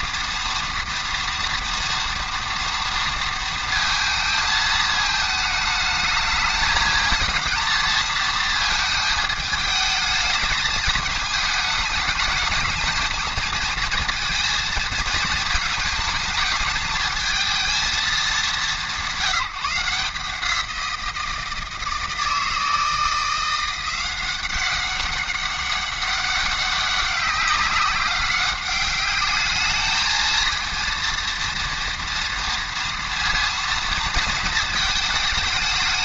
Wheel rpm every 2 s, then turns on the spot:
230, 230, 220, 220, 220, 220, 220, 230, 220, 210, 170, 160, 190, 190, 200, 230, 230, 220.
none